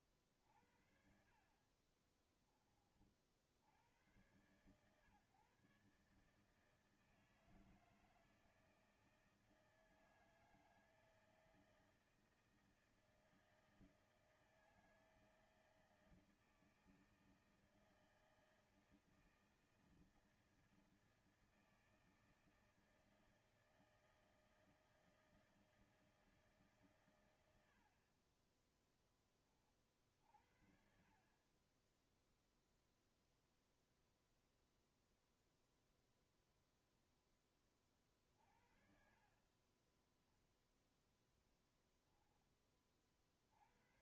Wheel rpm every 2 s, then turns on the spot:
40, 40, 100, 150, 160, 160, 160, 160, 160, 160, 160, 160, 160, 160, 30, 40, 0, 0, 0, 40, 10, 10.
2-4 38-42